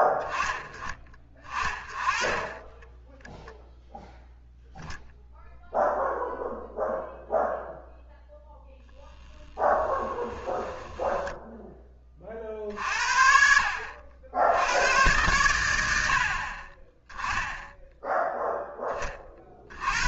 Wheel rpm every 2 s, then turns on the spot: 20, 10, 0, 0, 0, 20, 50, 90, 30, 10.
2-4 10-12